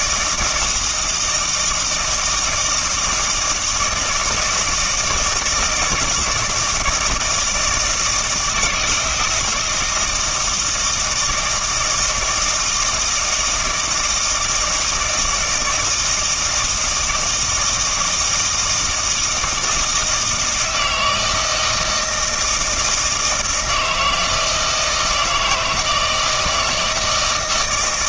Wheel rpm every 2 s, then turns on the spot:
160, 160, 160, 170, 160, 160, 160, 160, 160, 160, 160, 160, 160, 160.
none